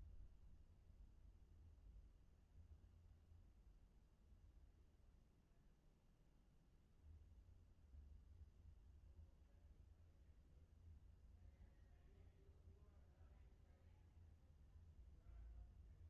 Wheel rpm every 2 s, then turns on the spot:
0, 0, 0, 0, 0, 0, 0, 0.
none